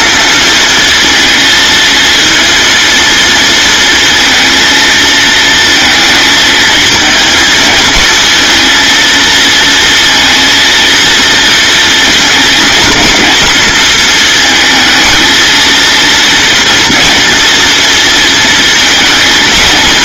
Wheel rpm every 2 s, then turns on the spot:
230, 230, 230, 220, 230, 230, 230, 220, 230, 220.
none